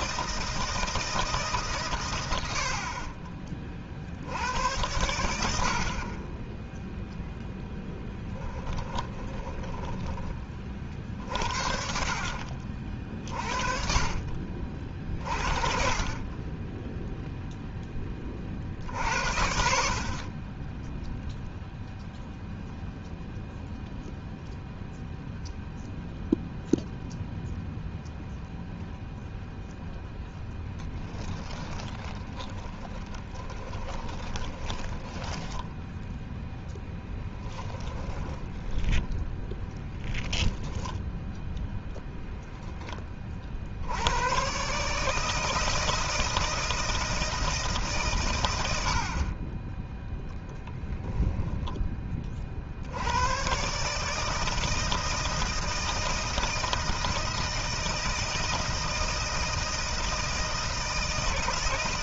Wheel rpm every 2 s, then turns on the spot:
160, 60, 90, 10, 10, 50, 50, 50, 10, 50, 20, 0, 0, 0, 0, 0, 10, 20, 0, 10, 0, 20, 140, 160, 100, 10, 60, 160, 160, 160, 160.
8-10 32-36 38-40